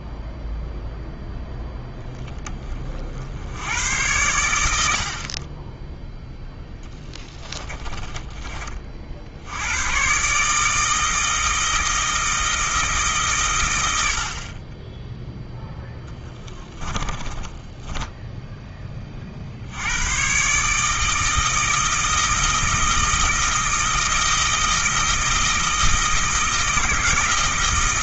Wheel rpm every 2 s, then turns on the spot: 0, 30, 80, 10, 40, 160, 160, 20, 20, 10, 150, 160, 160, 160.
6-8 16-18